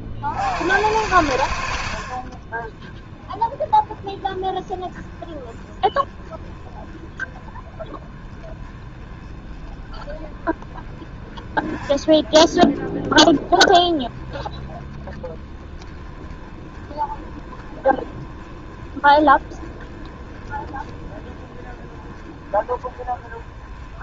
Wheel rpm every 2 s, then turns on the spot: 40, 60, 20, 20, 20, 20, 20, 20, 20, 20, 20, 20.
none